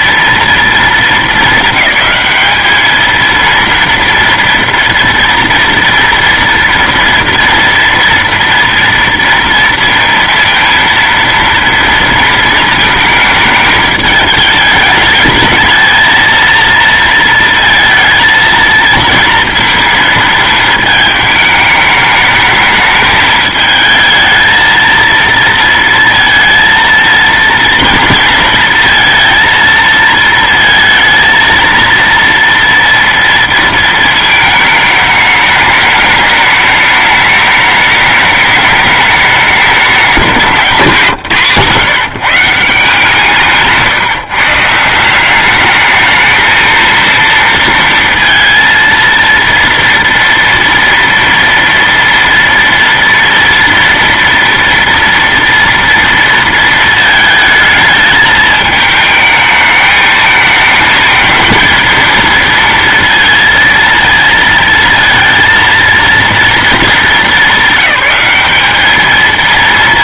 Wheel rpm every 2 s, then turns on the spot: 230, 210, 230, 230, 230, 230, 230, 210, 230, 230, 220, 210, 220, 230, 230, 220, 230, 220, 210, 210, 180, 160, 140, 220, 230, 230, 230, 230, 230, 220, 220, 230, 230, 230, 210.
none